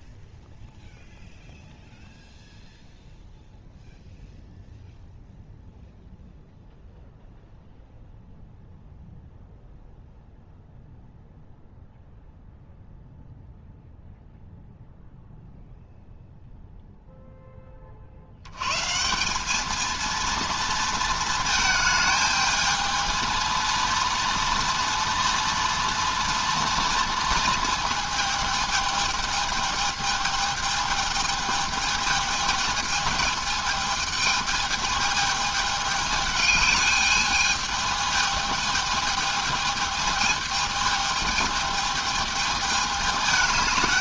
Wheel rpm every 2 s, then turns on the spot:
0, 0, 0, 0, 0, 0, 0, 0, 0, 110, 230, 220, 230, 230, 220, 220, 220, 220, 210, 220, 220, 210.
none